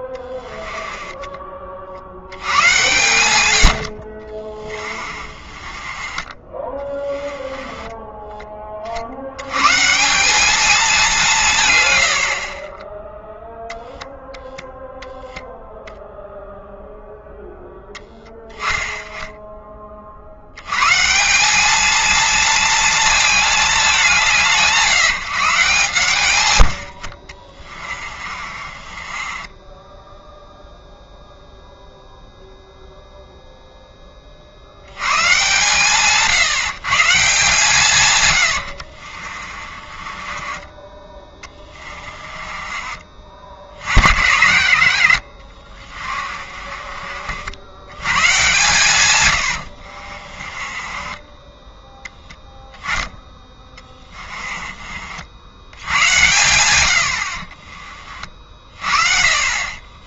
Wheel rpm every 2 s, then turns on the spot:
20, 110, 30, 20, 50, 200, 10, 0, 0, 10, 150, 220, 150, 60, 30, 0, 0, 100, 140, 60, 20, 30, 60, 40, 120, 20, 10, 40, 90, 40.
4-8 26-30 38-42 50-52